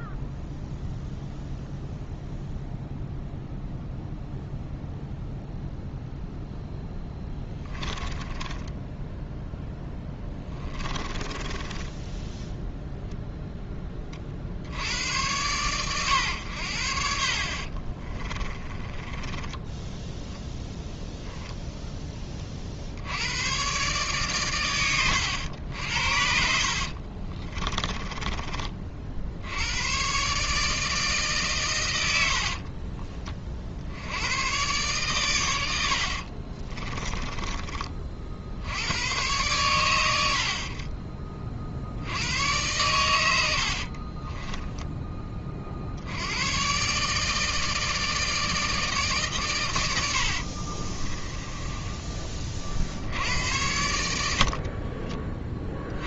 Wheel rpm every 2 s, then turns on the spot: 0, 0, 0, 0, 10, 20, 0, 70, 80, 30, 10, 50, 110, 60, 30, 150, 40, 120, 30, 80, 50, 100, 10, 120, 160, 50, 40, 50.
8-12 18-20 26-28 32-34 36-38 44-46 50-52 54-56